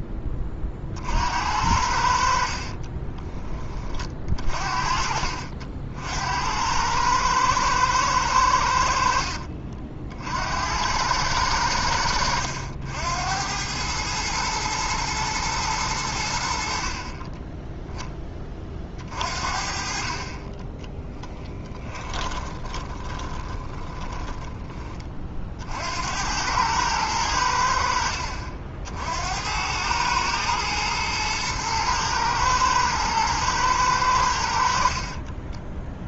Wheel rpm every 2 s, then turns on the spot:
40, 50, 40, 90, 90, 80, 80, 110, 60, 30, 20, 20, 20, 100, 60, 110, 120, 50.
2-4 22-24